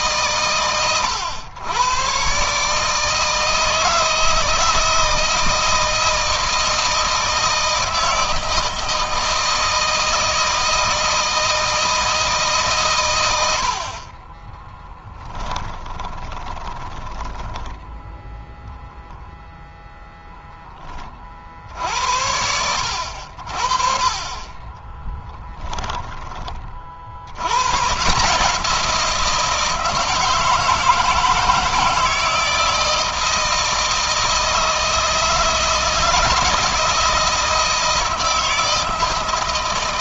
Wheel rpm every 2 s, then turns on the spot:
120, 150, 160, 170, 160, 160, 130, 10, 20, 0, 10, 80, 20, 60, 170, 160, 160, 160, 160, 160.
14-18 24-26